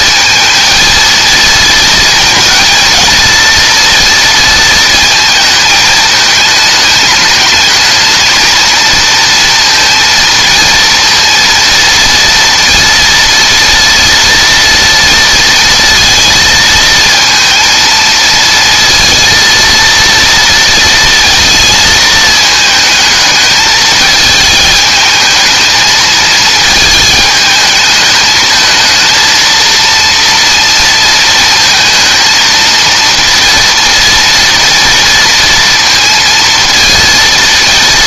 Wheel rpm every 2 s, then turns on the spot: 230, 230, 220, 210, 230, 230, 230, 230, 230, 230, 230, 220, 220, 220, 230, 230, 230, 230, 230.
none